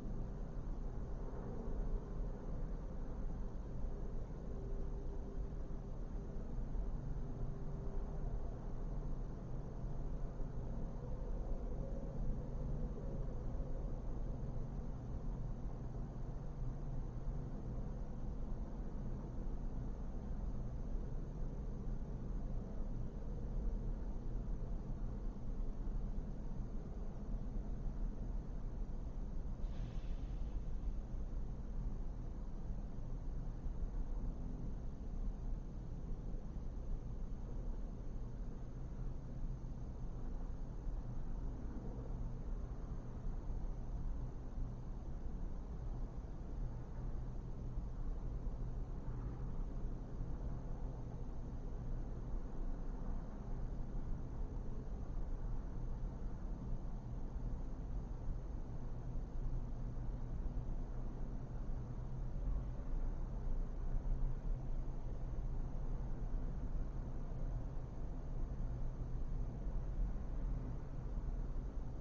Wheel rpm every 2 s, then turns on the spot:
0, 0, 0, 0, 0, 0, 0, 0, 0, 0, 0, 0, 0, 0, 0, 0, 0, 0, 0, 0, 0, 0, 0, 0, 0, 0, 0, 0, 0, 0, 0, 0, 0, 0, 0, 0.
none